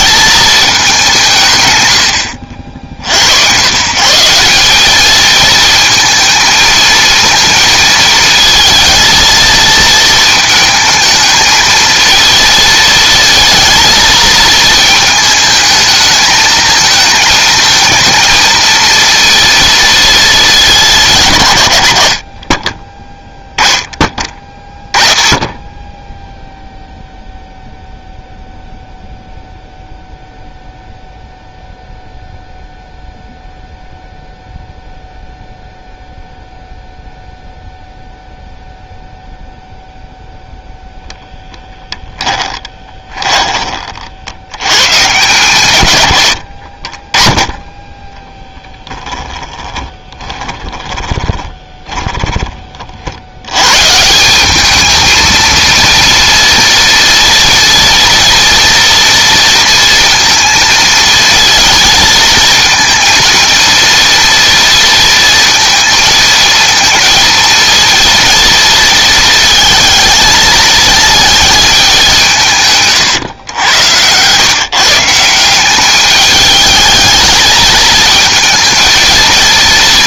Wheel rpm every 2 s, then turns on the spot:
210, 70, 190, 220, 220, 220, 230, 220, 220, 230, 190, 30, 10, 0, 0, 0, 0, 0, 0, 0, 0, 10, 90, 40, 10, 20, 40, 210, 230, 230, 220, 230, 230, 230, 230, 220, 140, 150, 210, 220.
42-44 50-52 72-74